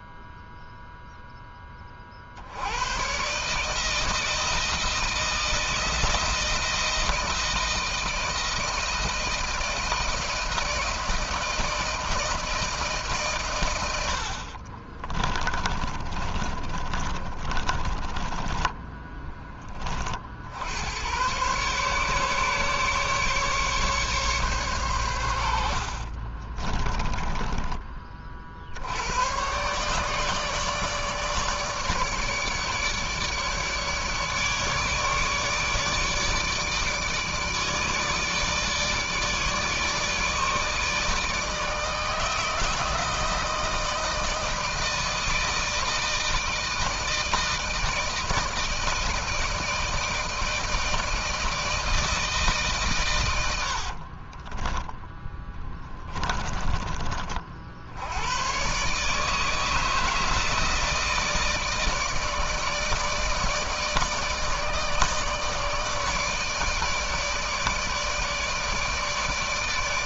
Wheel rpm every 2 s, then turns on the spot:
0, 80, 160, 160, 160, 160, 160, 50, 30, 20, 80, 140, 130, 30, 60, 150, 150, 150, 150, 150, 150, 160, 160, 160, 160, 160, 140, 20, 20, 130, 160, 160, 160, 160, 160.
14-20 26-28 54-56